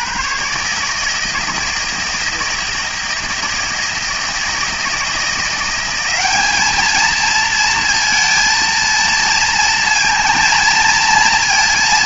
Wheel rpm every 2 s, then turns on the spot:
140, 160, 160, 210, 230, 230.
none